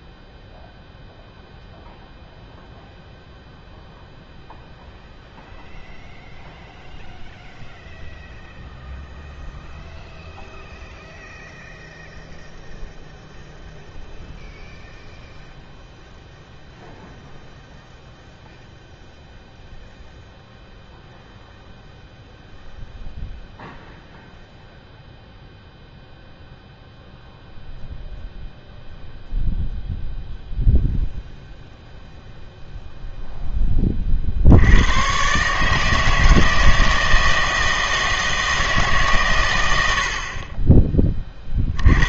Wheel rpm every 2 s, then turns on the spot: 0, 0, 0, 0, 0, 0, 0, 0, 0, 0, 0, 0, 0, 0, 0, 0, 0, 80, 160, 160, 30.
none